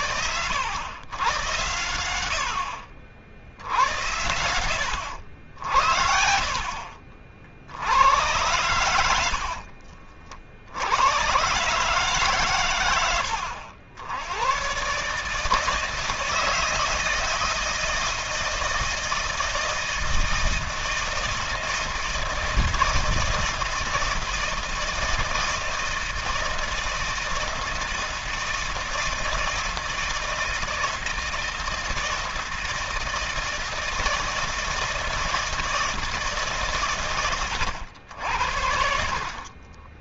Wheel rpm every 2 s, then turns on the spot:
100, 70, 90, 50, 90, 80, 110, 140, 160, 160, 160, 160, 160, 160, 160, 160, 160, 160, 130, 60.
8-10